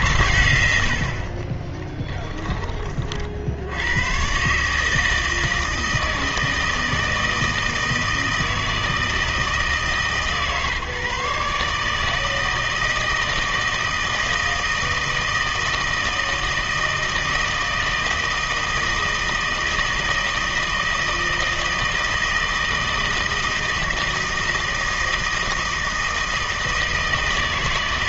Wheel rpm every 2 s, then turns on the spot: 100, 20, 140, 160, 160, 140, 160, 160, 160, 160, 160, 160, 160, 160.
none